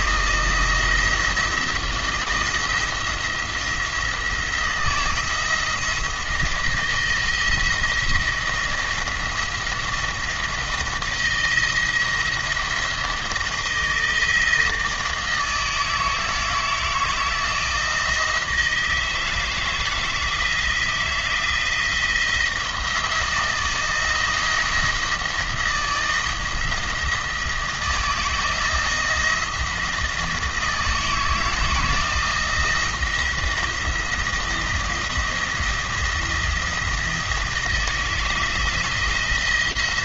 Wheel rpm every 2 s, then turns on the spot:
170, 170, 170, 170, 170, 170, 160, 160, 160, 160, 160, 170, 170, 160, 170, 160, 170, 170, 170, 160.
none